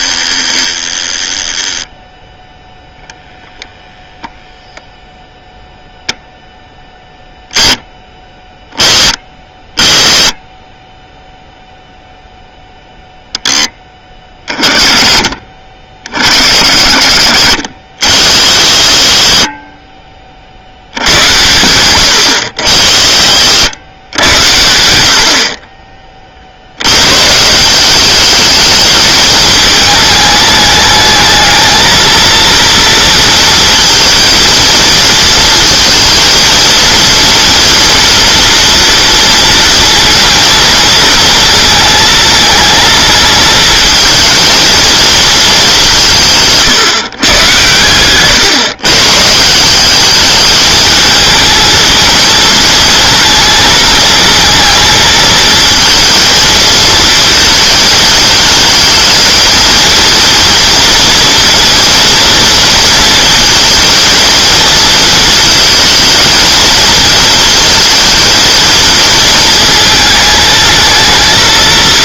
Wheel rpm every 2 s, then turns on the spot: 10, 0, 0, 0, 20, 10, 0, 30, 60, 70, 70, 70, 80, 90, 210, 210, 230, 230, 230, 240, 230, 230, 230, 140, 130, 220, 220, 220, 220, 220, 230, 230, 230, 220, 230, 220.
none